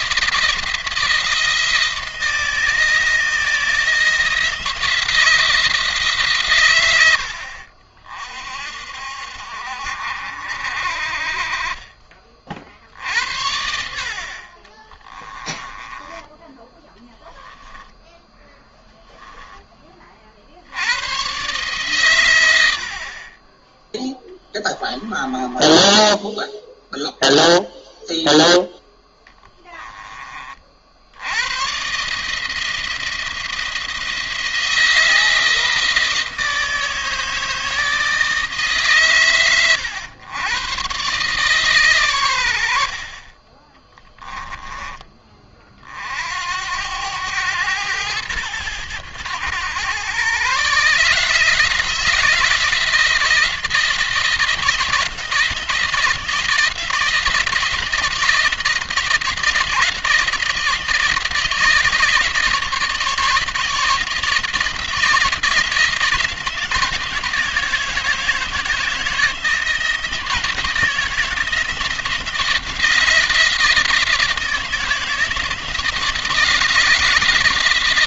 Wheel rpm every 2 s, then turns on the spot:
160, 160, 170, 110, 60, 50, 50, 30, 10, 10, 80, 80, 30, 0, 0, 50, 160, 160, 160, 140, 120, 70, 20, 90, 100, 140, 160, 170, 160, 160, 170, 160, 170, 160, 160, 170, 170, 160, 150.
14-20 24-26 42-44